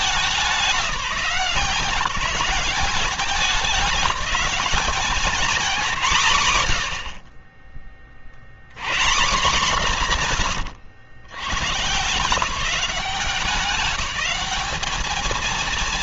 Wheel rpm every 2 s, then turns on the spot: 200, 190, 200, 130, 100, 130, 160, 200.
10-12